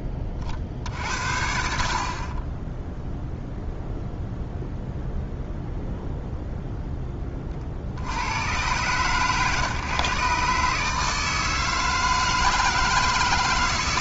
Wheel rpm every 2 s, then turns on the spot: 50, 20, 0, 0, 110, 150, 160.
none